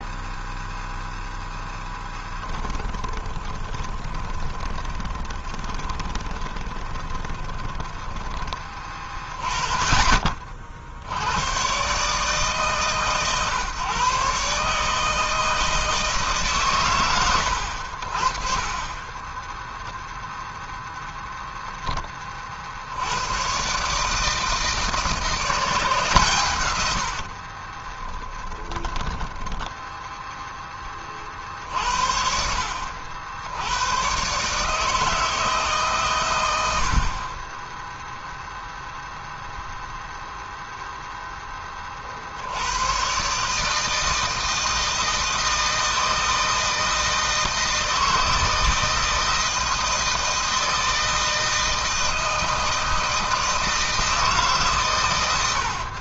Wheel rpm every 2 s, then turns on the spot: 0, 20, 20, 10, 30, 90, 140, 160, 100, 20, 0, 90, 170, 60, 10, 40, 80, 160, 40, 0, 10, 130, 160, 160, 160, 160, 160, 120.
2-8 18-20 26-30